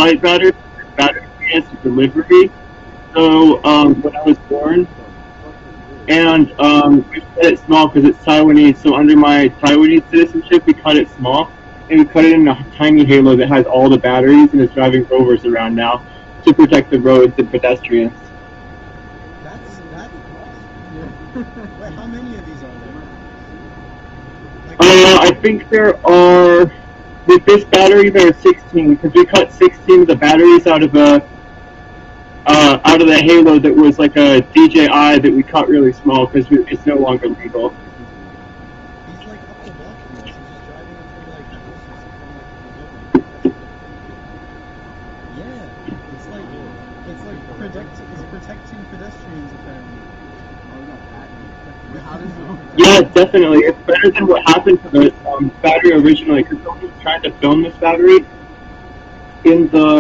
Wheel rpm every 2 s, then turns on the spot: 0, 0, 0, 0, 0, 0, 0, 0, 0, 0, 0, 0, 0, 0, 0, 0, 0, 0, 0, 0, 0, 0, 0, 0, 0, 0, 0, 0, 0, 0.
none